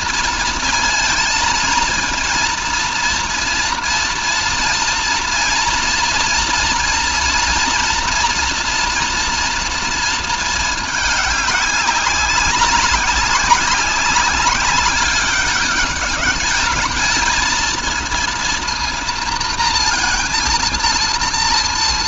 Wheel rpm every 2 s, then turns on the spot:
230, 230, 230, 230, 230, 210, 200, 200, 220, 230, 230.
none